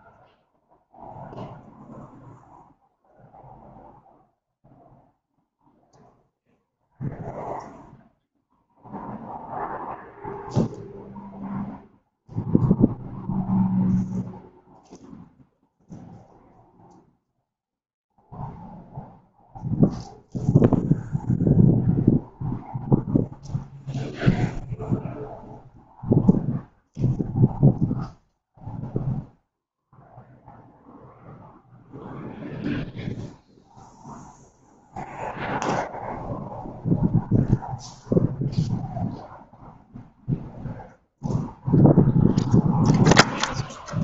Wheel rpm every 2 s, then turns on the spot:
0, 0, 0, 0, 0, 0, 0, 0, 0, 0, 0, 0, 0, 0, 0, 0, 0, 0, 0, 0, 0, 0.
none